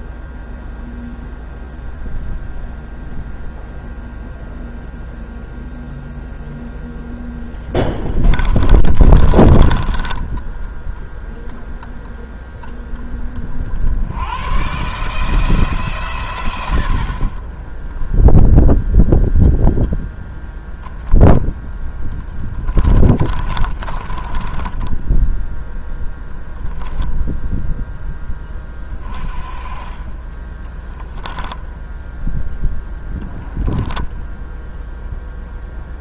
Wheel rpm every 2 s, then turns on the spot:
0, 0, 0, 20, 10, 0, 90, 110, 0, 0, 10, 30, 0, 10, 20, 0, 0, 0.
6-10 20-24